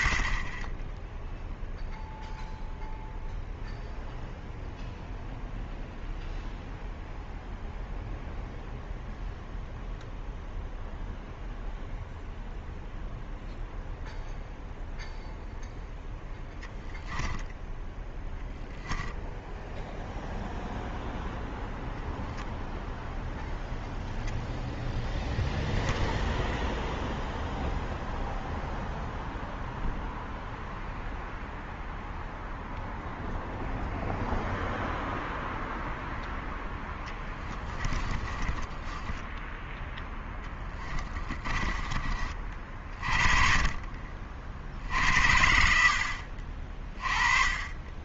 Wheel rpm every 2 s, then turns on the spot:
10, 0, 0, 0, 0, 0, 0, 0, 0, 0, 0, 0, 0, 0, 0, 0, 0, 0, 0, 20, 20, 40, 60, 40.
38-42